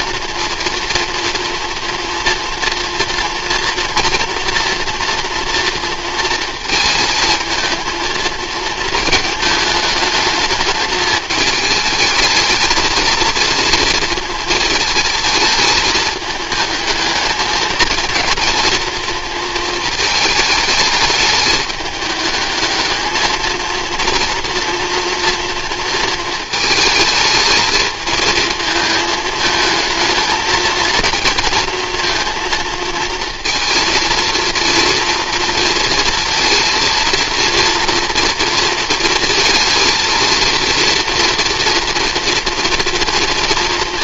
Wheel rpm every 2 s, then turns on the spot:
230, 240, 230, 220, 220, 220, 220, 220, 220, 230, 210, 220, 230, 220, 220, 230, 230, 230, 230, 230, 230, 230.
none